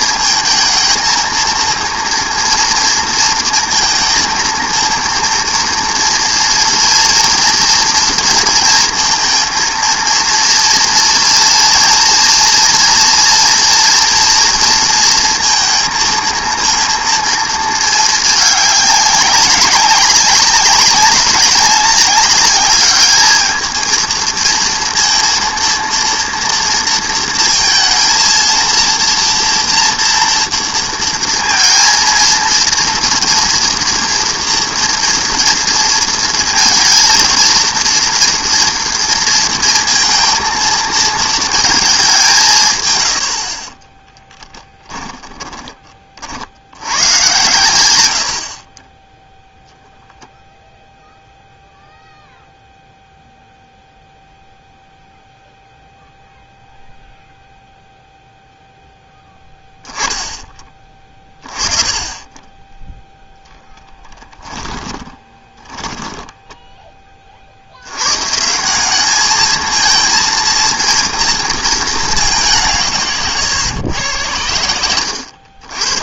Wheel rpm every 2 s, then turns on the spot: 220, 230, 230, 230, 230, 230, 230, 230, 230, 210, 200, 210, 230, 230, 230, 230, 230, 240, 230, 230, 230, 150, 10, 90, 40, 0, 0, 0, 0, 0, 20, 10, 20, 10, 170, 230, 180, 100.
44-46 64-66